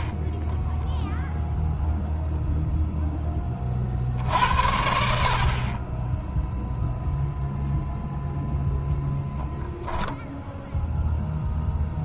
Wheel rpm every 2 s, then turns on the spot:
0, 0, 50, 0, 0, 0.
none